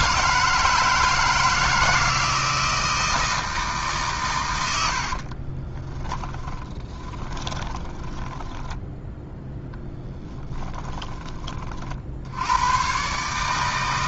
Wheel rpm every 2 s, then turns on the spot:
160, 160, 70, 20, 10, 20, 110.
4-12